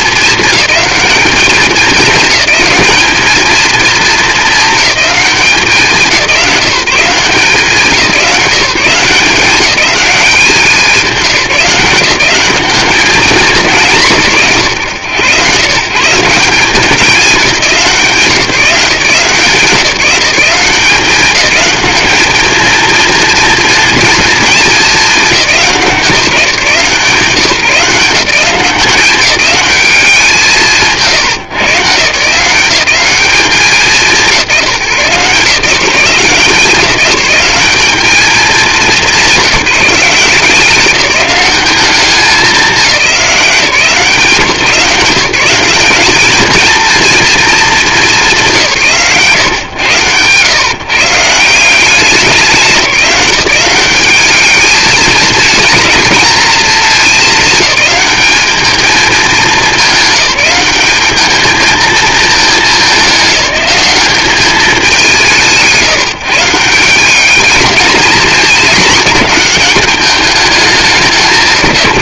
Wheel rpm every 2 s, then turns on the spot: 210, 210, 210, 160, 170, 180, 190, 110, 190, 170, 180, 220, 220, 160, 190, 160, 170, 170, 180, 200, 190, 200, 150, 220, 160, 140, 170, 210, 230, 210, 200, 210, 200, 170, 220, 190.
none